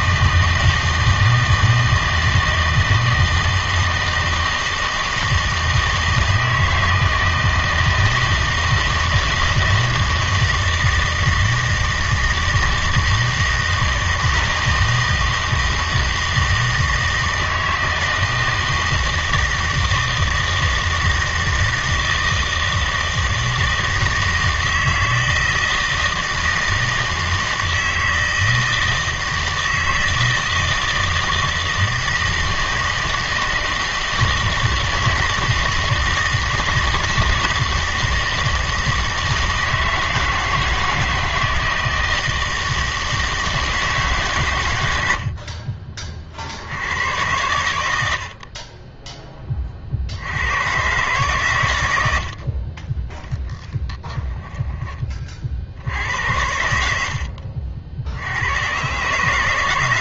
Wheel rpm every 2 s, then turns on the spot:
160, 160, 160, 160, 160, 160, 160, 160, 160, 160, 160, 160, 160, 160, 160, 160, 160, 160, 160, 160, 160, 160, 100, 90, 30, 120, 20, 10, 80, 120.
none